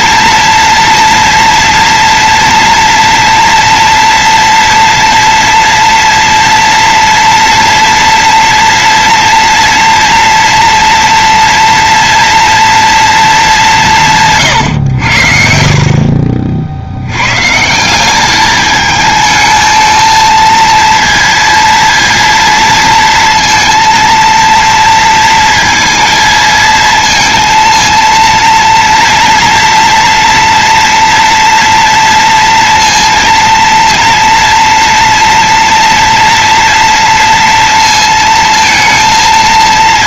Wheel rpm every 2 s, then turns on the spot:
240, 230, 230, 230, 230, 230, 230, 110, 60, 210, 230, 230, 230, 230, 230, 230, 230, 230, 230, 230.
none